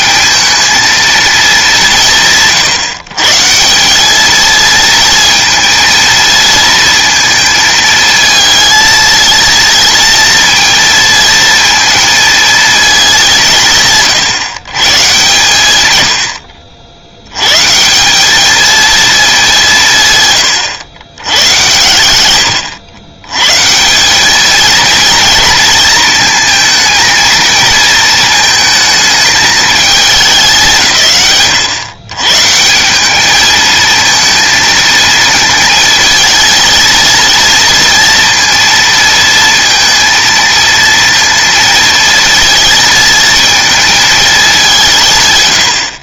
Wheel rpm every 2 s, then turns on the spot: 220, 150, 230, 230, 230, 230, 220, 140, 80, 220, 100, 110, 220, 220, 220, 150, 190, 220, 230, 230, 230, 230, 180.
none